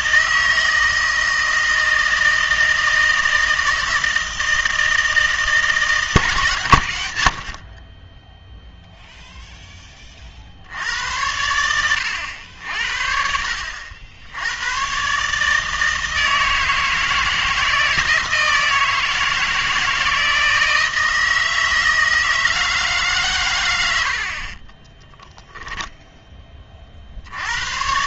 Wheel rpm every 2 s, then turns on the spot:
160, 160, 160, 120, 0, 70, 70, 100, 160, 160, 160, 160, 30, 30.
24-26